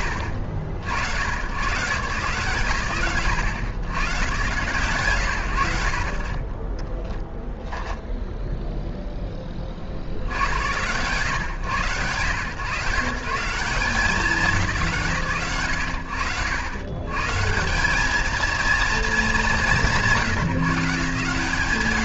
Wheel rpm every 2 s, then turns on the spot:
80, 100, 120, 10, 10, 110, 150, 170, 90, 220, 150.
6-8